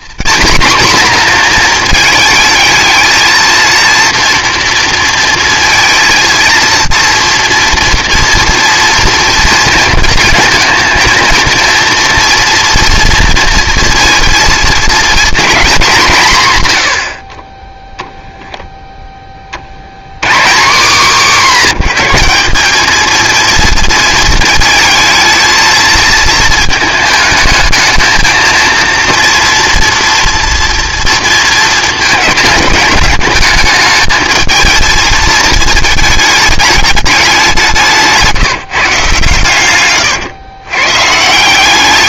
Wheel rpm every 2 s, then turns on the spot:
230, 220, 230, 230, 230, 230, 230, 230, 130, 10, 160, 200, 230, 220, 230, 230, 220, 220, 210, 160, 130.
none